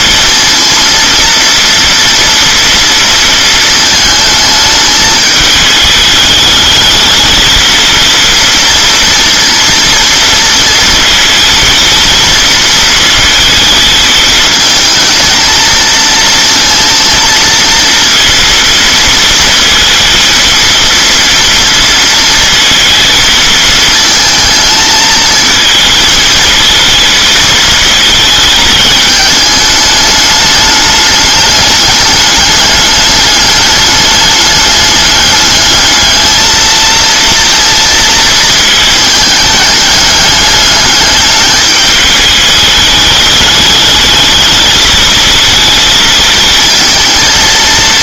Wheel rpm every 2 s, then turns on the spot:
230, 230, 220, 220, 230, 230, 230, 220, 230, 230, 230, 220, 220, 220, 220, 210, 210, 210, 230, 220, 210, 210, 220, 220.
none